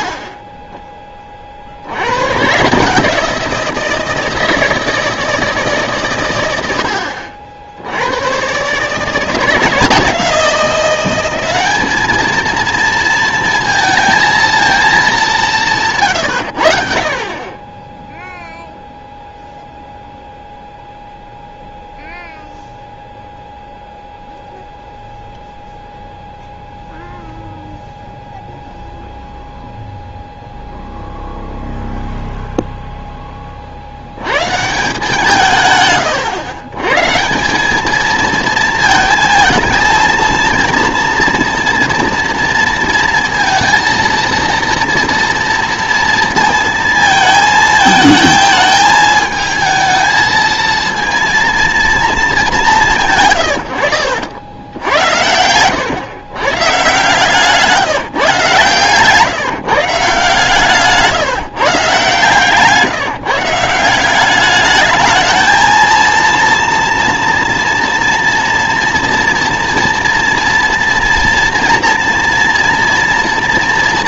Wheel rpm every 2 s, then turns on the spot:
10, 150, 160, 80, 140, 180, 220, 220, 60, 0, 0, 0, 0, 0, 0, 0, 0, 150, 120, 230, 230, 230, 230, 230, 210, 230, 180, 80, 130, 140, 150, 150, 210, 230, 230, 230, 230.
60-62